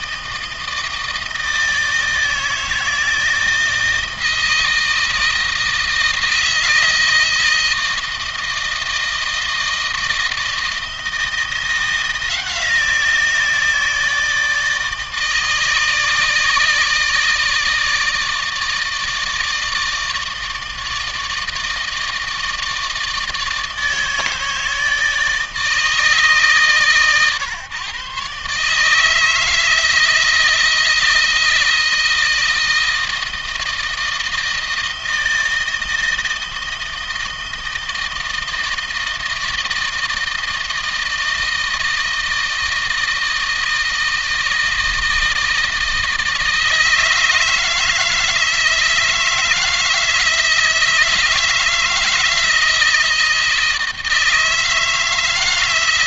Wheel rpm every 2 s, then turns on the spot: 160, 160, 160, 160, 160, 160, 170, 160, 160, 160, 160, 160, 160, 140, 150, 160, 160, 160, 160, 160, 160, 160, 160, 160, 160, 160, 160, 160.
none